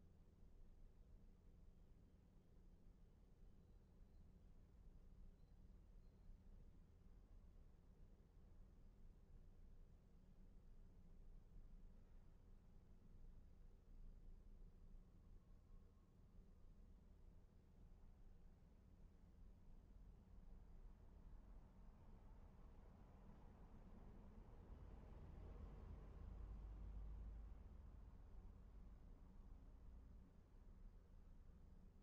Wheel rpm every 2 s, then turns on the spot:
0, 0, 0, 0, 0, 0, 0, 0, 0, 0, 0, 0, 0, 0, 0, 0.
none